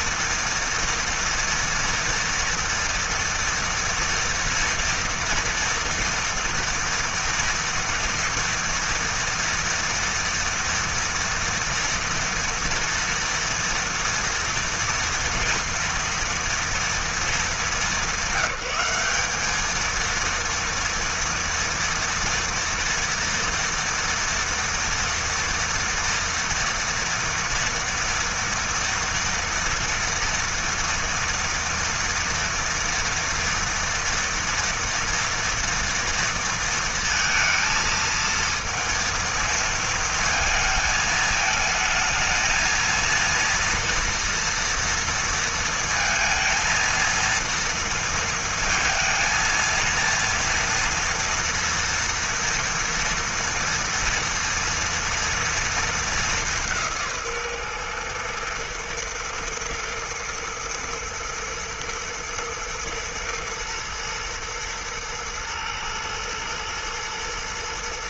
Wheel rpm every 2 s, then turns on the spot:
230, 230, 230, 230, 240, 230, 230, 230, 220, 190, 230, 230, 230, 240, 230, 230, 240, 240, 230, 230, 220, 230, 230, 230, 220, 230, 230, 230, 150, 110, 110, 120, 110, 110.
none